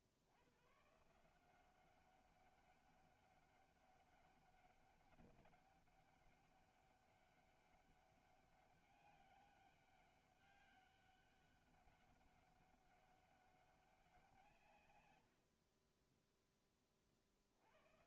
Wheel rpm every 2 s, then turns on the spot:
80, 200, 200, 200, 200, 200, 200, 150, 10.
none